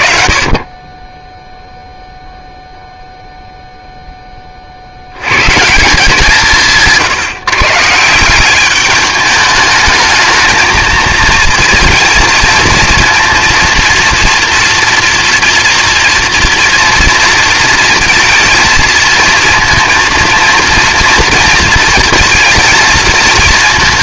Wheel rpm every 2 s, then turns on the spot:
30, 0, 50, 160, 200, 220, 230, 230, 230, 230, 230, 220.
none